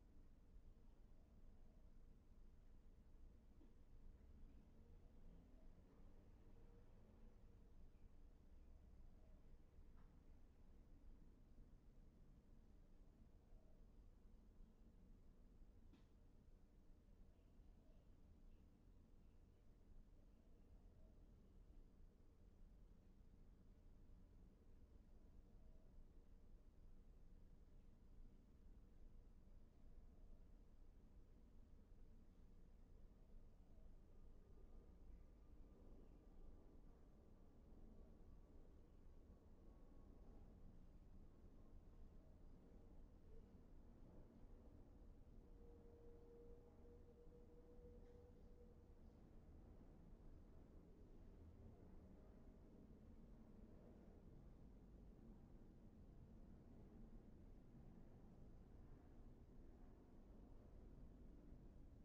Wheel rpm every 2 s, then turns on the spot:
0, 0, 0, 0, 0, 0, 0, 0, 0, 0, 0, 0, 0, 0, 0, 0, 0, 0, 0, 0, 0, 0, 0, 0, 0, 0, 0, 0, 0, 0, 0.
none